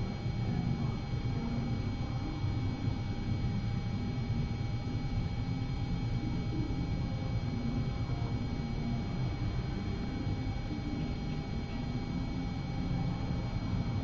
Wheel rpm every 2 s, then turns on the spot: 0, 0, 0, 0, 0, 0, 0.
none